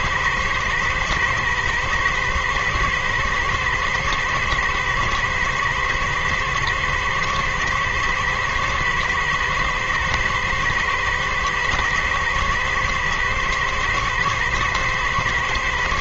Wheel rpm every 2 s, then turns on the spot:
110, 120, 110, 110, 110, 110, 110, 110.
none